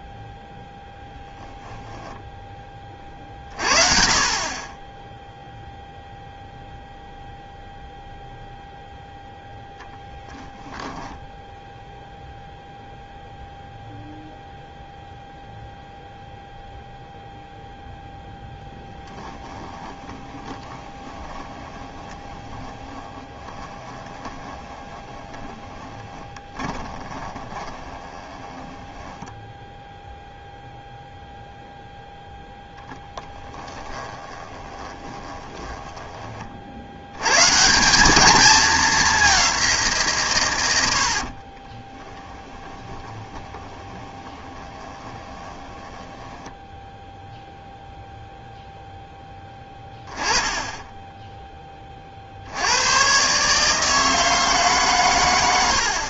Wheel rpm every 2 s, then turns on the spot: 0, 20, 20, 0, 0, 10, 0, 0, 0, 10, 20, 20, 20, 20, 10, 0, 0, 20, 70, 210, 90, 20, 20, 0, 0, 10, 100, 140.
10-12 18-30 34-36 42-46